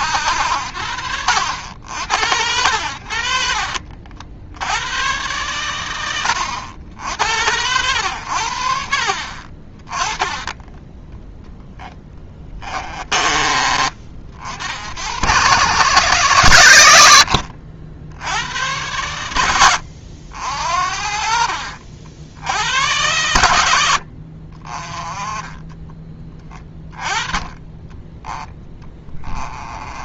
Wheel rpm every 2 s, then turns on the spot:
80, 90, 80, 70, 60, 10, 30, 60, 100, 90, 60, 90, 40, 20, 10.
12-14 28-30